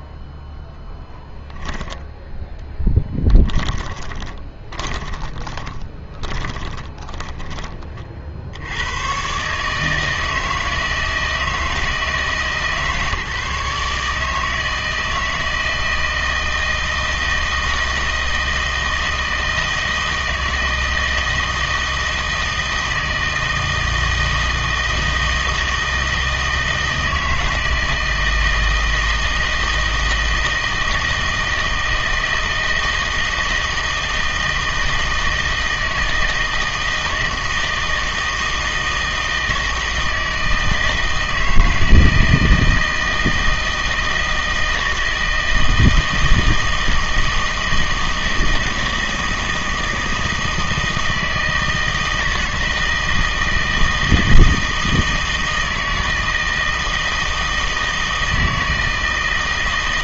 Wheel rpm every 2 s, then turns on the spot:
0, 10, 20, 30, 80, 160, 150, 160, 160, 160, 160, 160, 160, 160, 160, 160, 160, 160, 160, 160, 160, 160, 160, 160, 170, 160, 160, 160, 160, 160.
4-8